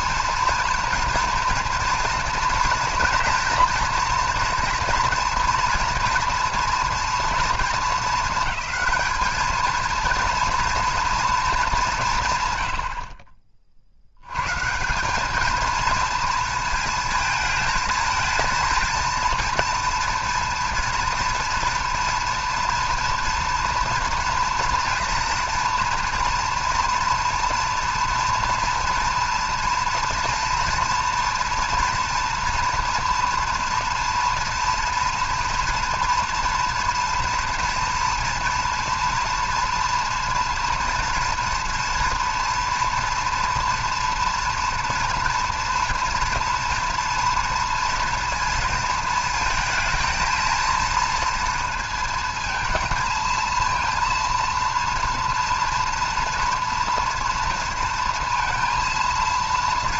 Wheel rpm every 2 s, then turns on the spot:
230, 230, 240, 230, 220, 230, 110, 140, 220, 230, 230, 230, 230, 230, 230, 240, 230, 230, 230, 230, 230, 230, 230, 230, 230, 230, 230, 240, 230, 230.
none